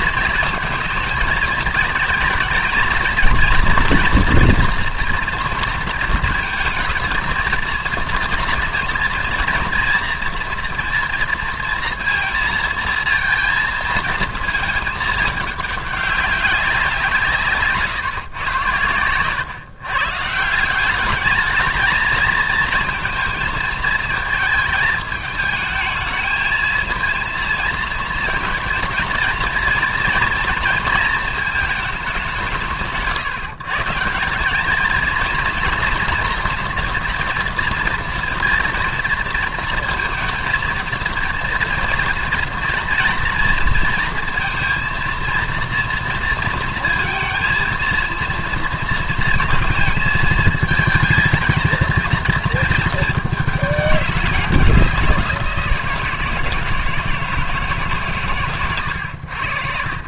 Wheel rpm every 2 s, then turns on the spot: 230, 230, 240, 230, 230, 230, 230, 220, 170, 110, 200, 220, 220, 230, 230, 220, 150, 220, 240, 230, 230, 230, 230, 220, 230, 220, 220, 180, 160, 90.
none